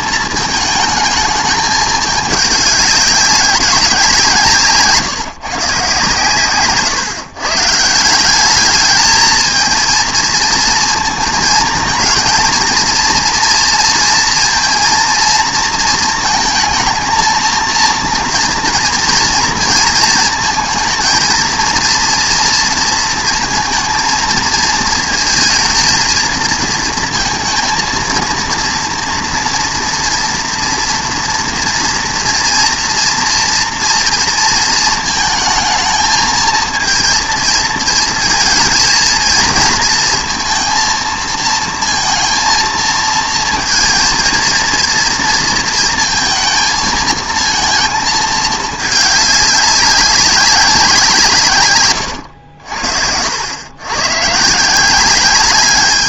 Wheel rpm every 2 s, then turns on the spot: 210, 200, 150, 140, 220, 230, 230, 230, 220, 230, 230, 230, 220, 230, 230, 230, 230, 230, 230, 220, 230, 230, 230, 220, 210, 180, 70, 180.
none